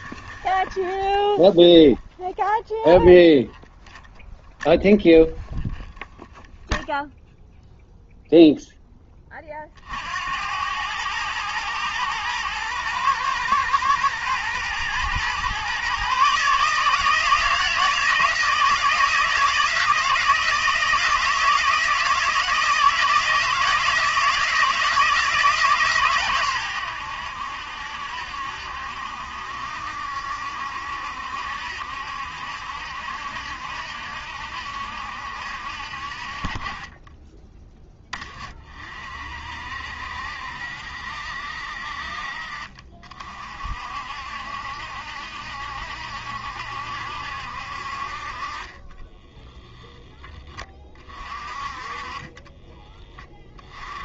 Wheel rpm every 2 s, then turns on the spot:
20, 0, 0, 0, 0, 90, 110, 120, 150, 160, 160, 160, 160, 110, 70, 70, 70, 70, 30, 30, 70, 50, 70, 70, 30, 20, 20.
48-50 52-54